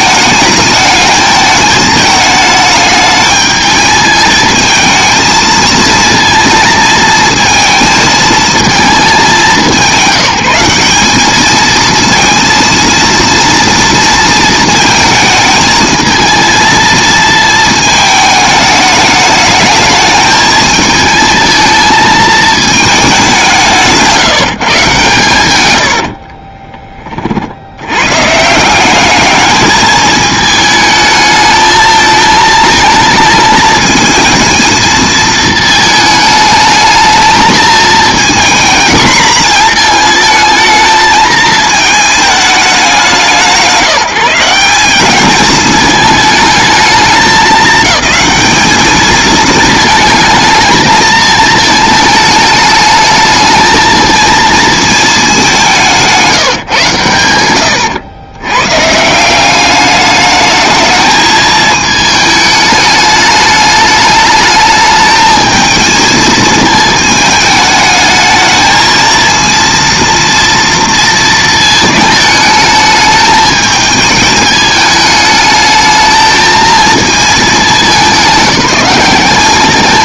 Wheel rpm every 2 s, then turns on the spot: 220, 210, 220, 230, 210, 200, 230, 220, 220, 210, 220, 220, 150, 30, 180, 220, 220, 220, 210, 230, 220, 190, 190, 220, 220, 220, 210, 220, 140, 140, 220, 210, 220, 220, 220, 230, 210, 210, 220, 200.
26-28